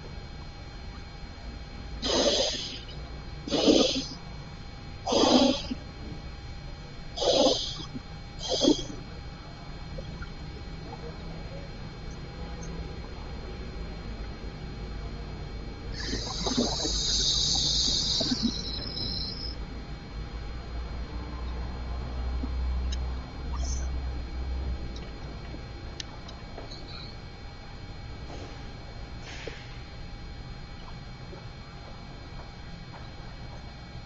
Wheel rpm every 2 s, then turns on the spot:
0, 0, 0, 0, 0, 0, 0, 0, 0, 0, 0, 0, 0, 0, 0, 0, 0.
none